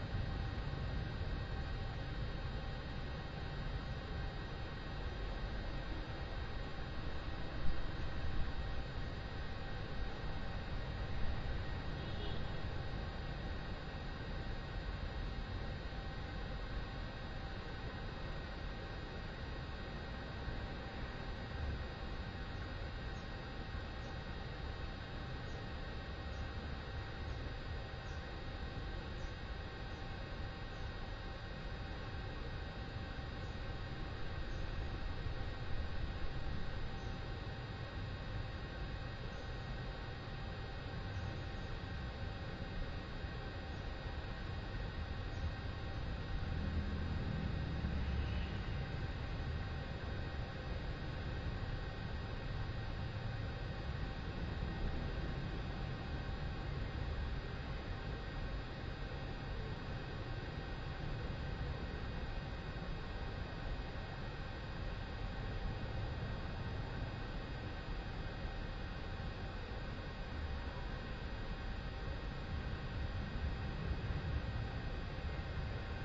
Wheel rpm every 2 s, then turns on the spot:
0, 0, 0, 0, 0, 0, 0, 0, 0, 0, 0, 0, 0, 0, 0, 0, 0, 0, 0, 0, 0, 0, 0, 0, 0, 0, 0, 0, 0, 0, 0, 0, 0, 0, 0, 0, 0, 0.
none